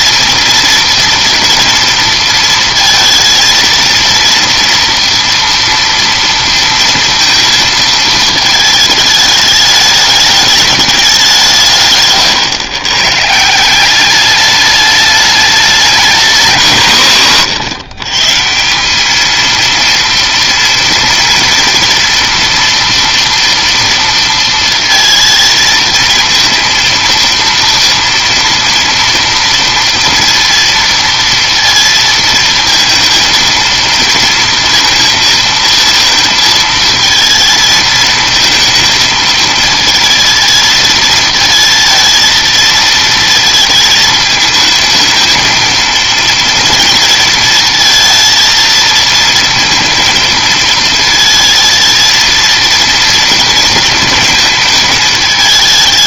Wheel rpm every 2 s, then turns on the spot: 230, 230, 230, 230, 220, 210, 120, 210, 150, 180, 240, 230, 230, 230, 230, 230, 230, 230, 220, 220, 220, 220, 220, 230, 230, 230, 230, 220.
none